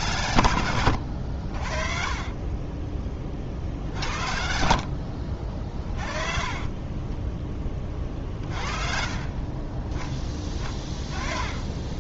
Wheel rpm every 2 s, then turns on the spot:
100, 20, 60, 30, 40, 30.
0-6